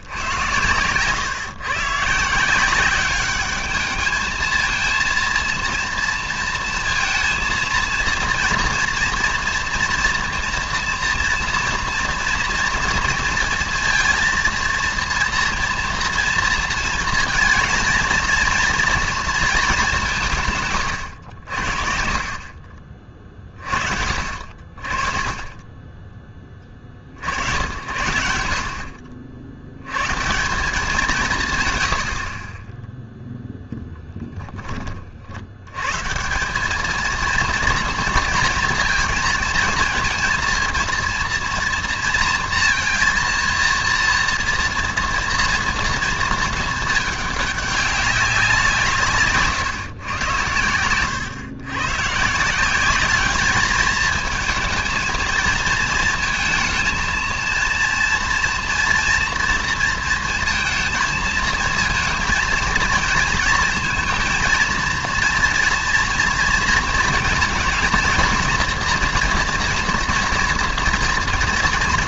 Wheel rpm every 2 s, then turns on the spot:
120, 170, 220, 230, 230, 240, 230, 230, 230, 230, 140, 50, 40, 20, 70, 180, 20, 20, 190, 230, 230, 230, 230, 220, 180, 100, 170, 220, 230, 230, 230, 230, 230, 230, 230, 230.
none